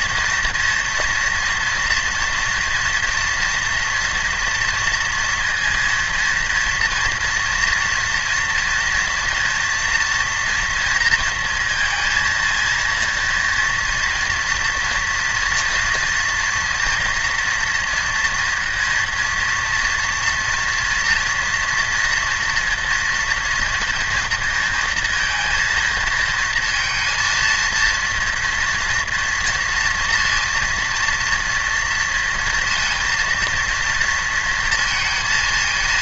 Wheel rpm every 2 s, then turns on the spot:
240, 240, 230, 230, 240, 230, 230, 230, 230, 230, 240, 230, 230, 230, 230, 230, 230, 220.
none